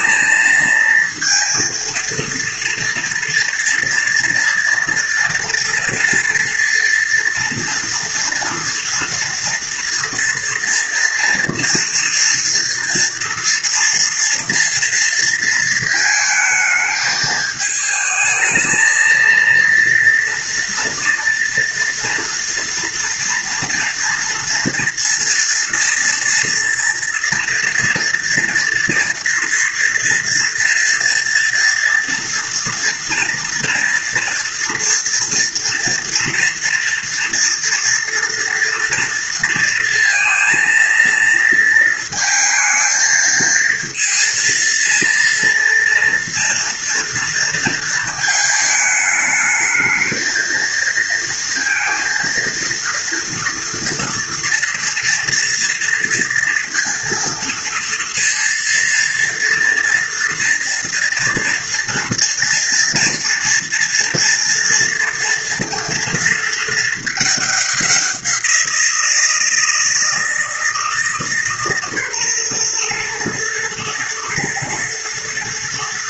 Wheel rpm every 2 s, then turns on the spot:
230, 230, 230, 240, 230, 230, 230, 230, 220, 230, 230, 230, 230, 230, 230, 230, 230, 230, 230, 230, 230, 220, 230, 230, 220, 230, 230, 230, 230, 230, 230, 230, 230, 220, 170, 160, 120, 110.
none